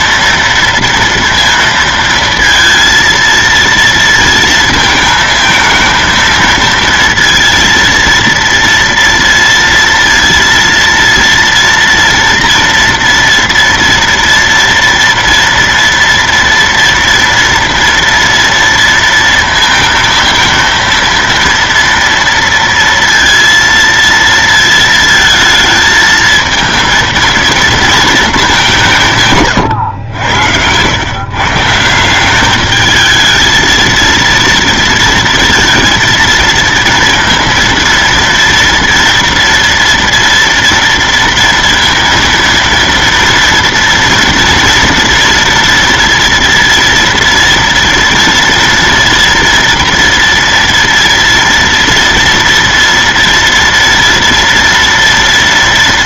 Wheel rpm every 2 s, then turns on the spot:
230, 230, 220, 230, 230, 230, 230, 230, 230, 230, 230, 230, 230, 220, 200, 90, 200, 230, 230, 230, 230, 230, 230, 230, 230, 230, 230, 230.
none